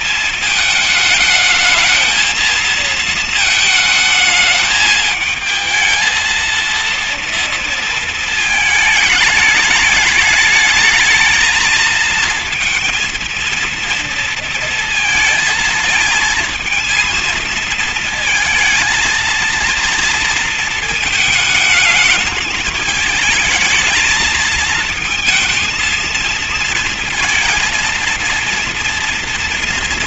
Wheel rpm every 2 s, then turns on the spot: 220, 230, 220, 230, 220, 210, 230, 230, 220, 220, 230, 220, 220, 230, 230.
none